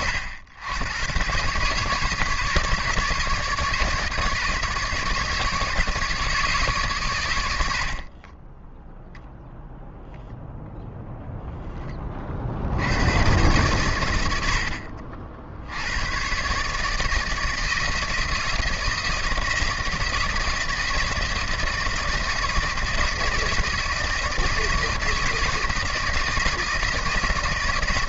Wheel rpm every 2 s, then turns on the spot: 90, 150, 150, 140, 0, 0, 80, 70, 150, 160, 160, 170, 160, 170.
none